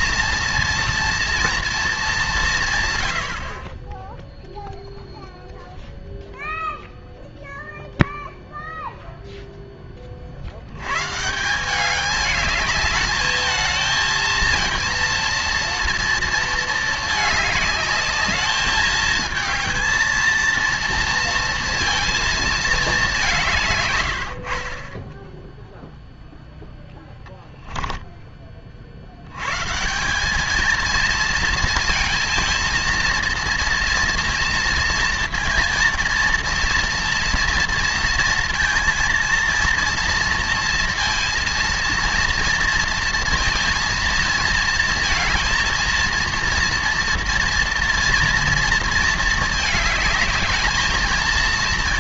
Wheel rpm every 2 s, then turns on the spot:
240, 140, 0, 0, 0, 90, 210, 230, 220, 220, 230, 220, 40, 0, 40, 220, 230, 230, 230, 230, 230, 230, 220, 230, 230, 220.
none